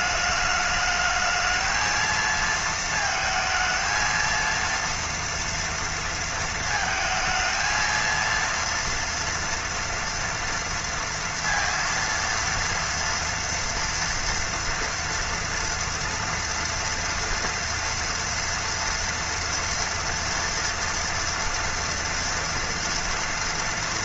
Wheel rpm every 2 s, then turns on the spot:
210, 220, 230, 230, 230, 230, 230, 230, 230, 230, 230, 230.
none